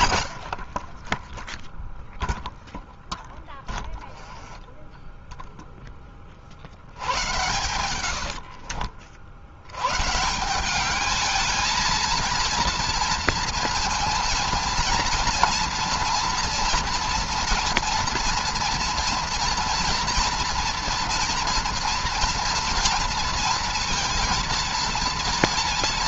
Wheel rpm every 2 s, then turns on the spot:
70, 0, 10, 50, 60, 160, 230, 230, 230, 230, 230, 230, 230.
4-6 8-10